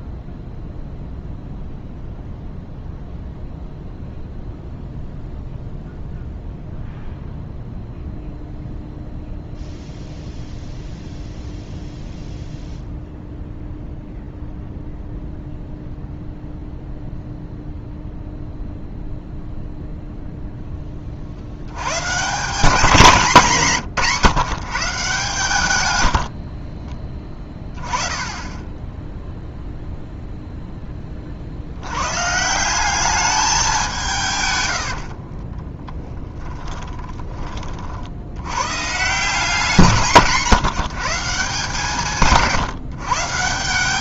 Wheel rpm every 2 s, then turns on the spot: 0, 0, 0, 0, 0, 0, 0, 0, 0, 0, 20, 200, 150, 20, 0, 20, 190, 70, 10, 150, 160, 150.
34-36